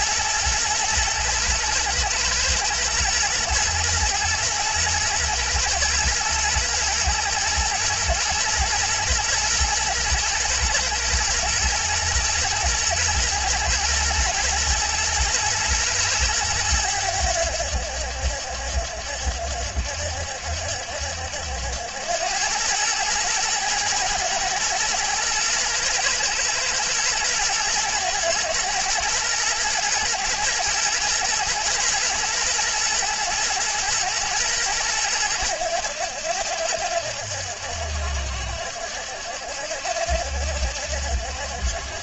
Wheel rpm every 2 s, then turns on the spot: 110, 110, 110, 110, 120, 110, 110, 120, 100, 70, 70, 110, 120, 110, 110, 120, 110, 110, 70, 70, 70.
none